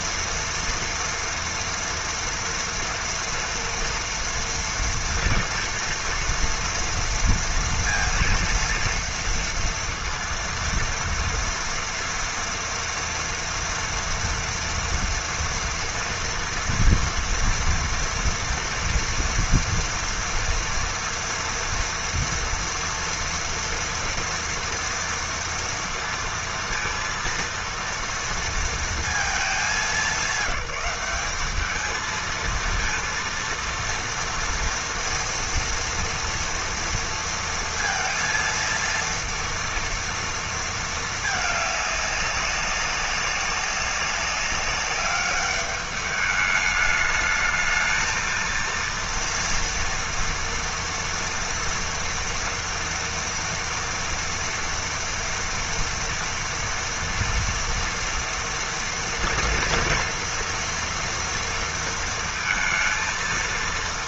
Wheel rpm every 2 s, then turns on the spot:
230, 230, 230, 230, 230, 230, 230, 230, 230, 230, 230, 230, 230, 230, 230, 190, 230, 230, 230, 230, 220, 200, 200, 210, 230, 230, 240, 230, 230, 230, 230, 230.
none